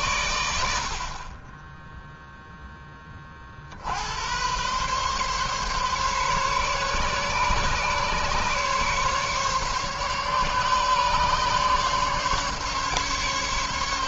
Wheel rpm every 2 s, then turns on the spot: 80, 30, 140, 140, 140, 140, 150.
none